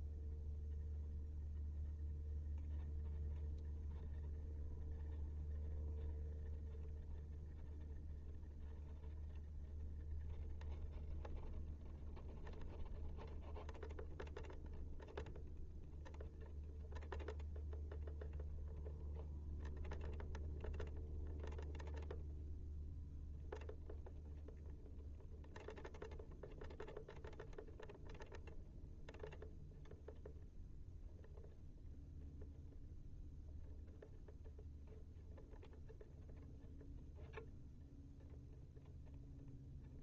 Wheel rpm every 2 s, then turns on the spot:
0, 0, 0, 0, 0, 0, 0, 0, 0, 0, 0, 0, 0, 0, 0, 0, 0, 0, 0, 0.
none